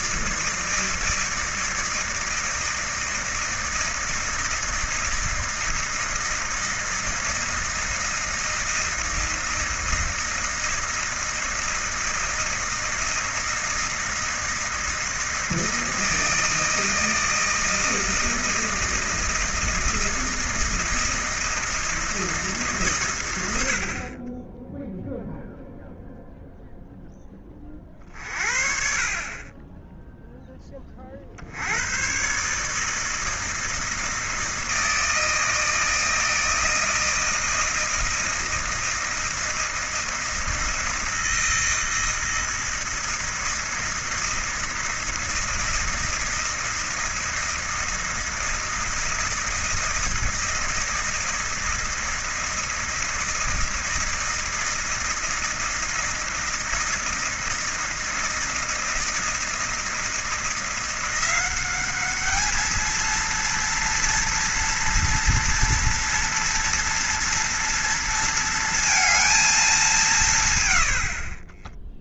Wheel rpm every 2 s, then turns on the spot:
160, 160, 160, 160, 160, 160, 160, 160, 160, 160, 160, 150, 10, 0, 40, 20, 150, 160, 160, 160, 160, 160, 160, 160, 160, 160, 160, 160, 160, 160, 170, 220, 230, 230, 230, 110.
none